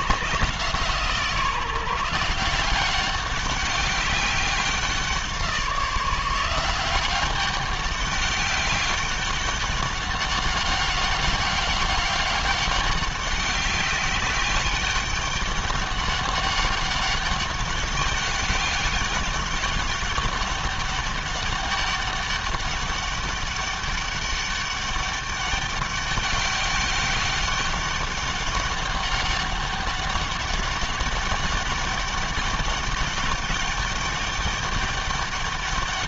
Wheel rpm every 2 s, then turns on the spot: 160, 180, 180, 180, 200, 200, 200, 200, 200, 200, 200, 200, 200, 200, 200, 200, 200, 200.
none